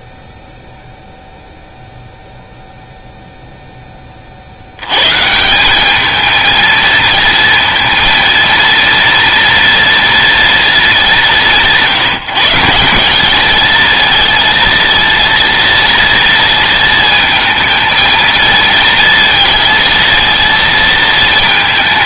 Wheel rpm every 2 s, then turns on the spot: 0, 0, 100, 230, 230, 210, 170, 230, 230, 230, 230.
none